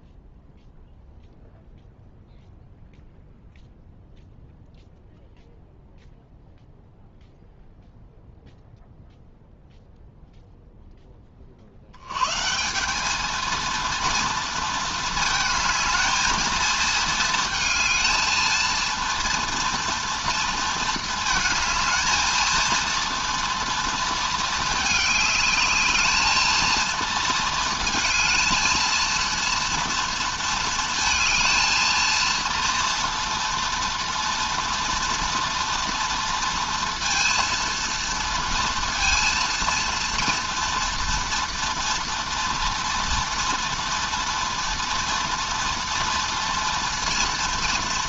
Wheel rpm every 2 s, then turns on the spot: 0, 0, 0, 0, 0, 0, 170, 230, 220, 230, 230, 230, 220, 230, 230, 230, 230, 230, 230, 230, 230, 230, 230, 230.
none